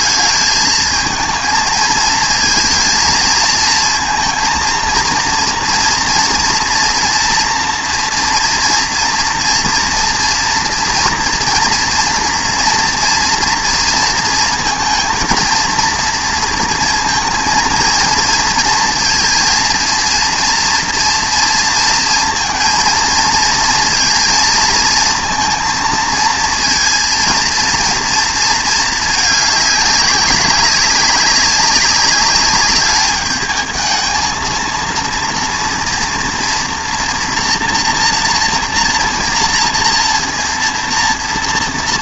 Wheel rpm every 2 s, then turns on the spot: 220, 230, 230, 240, 230, 230, 240, 230, 230, 230, 230, 230, 220, 230, 220, 200, 210, 230, 230, 230, 230.
none